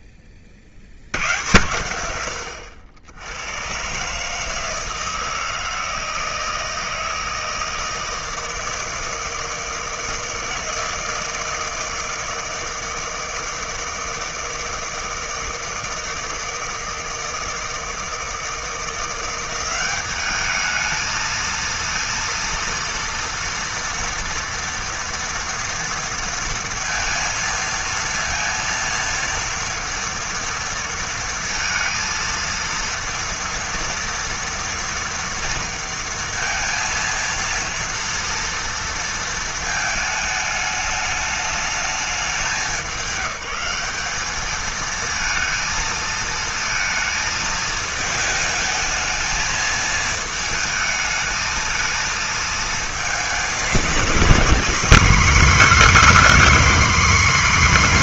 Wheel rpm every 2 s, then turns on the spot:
0, 100, 120, 160, 160, 160, 160, 160, 160, 160, 200, 230, 230, 230, 230, 230, 230, 230, 230, 230, 210, 200, 220, 220, 220, 220, 220, 250, 290.
none